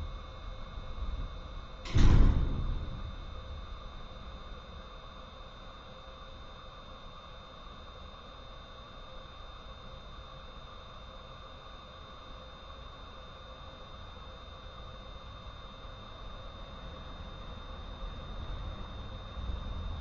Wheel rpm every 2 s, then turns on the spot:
0, 0, 0, 0, 0, 0, 0, 0, 0, 0.
none